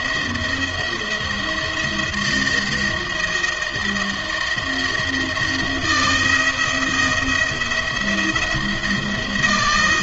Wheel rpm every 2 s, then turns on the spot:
170, 160, 160, 170, 170.
none